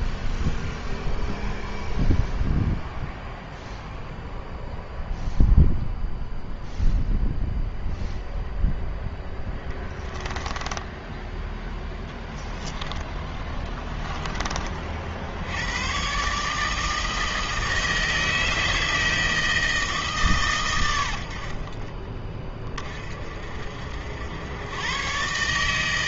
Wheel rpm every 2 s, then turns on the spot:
0, 0, 0, 0, 0, 10, 10, 40, 150, 160, 110, 30, 110.
10-12